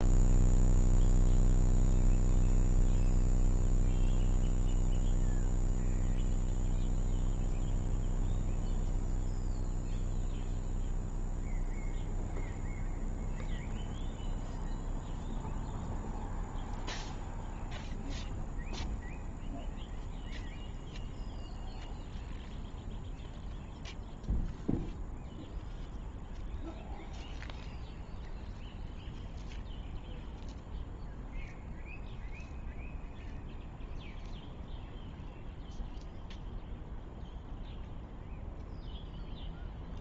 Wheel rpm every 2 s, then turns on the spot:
0, 0, 0, 0, 0, 0, 0, 0, 0, 0, 0, 0, 0, 0, 0, 0, 0, 0, 0, 0.
none